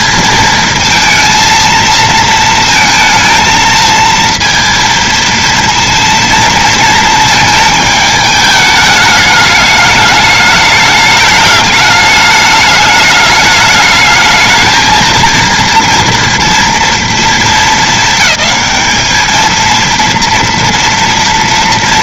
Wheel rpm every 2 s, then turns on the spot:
230, 220, 230, 230, 220, 210, 210, 220, 230, 220, 230.
none